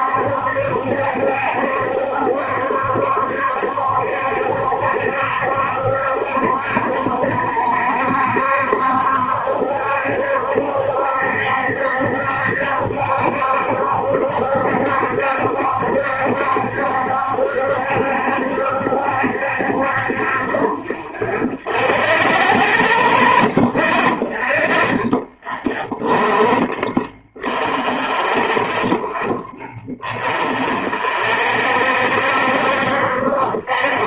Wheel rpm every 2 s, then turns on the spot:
70, 70, 70, 70, 70, 70, 70, 70, 70, 70, 40, 10, 20, 20, 20, 30, 60.
none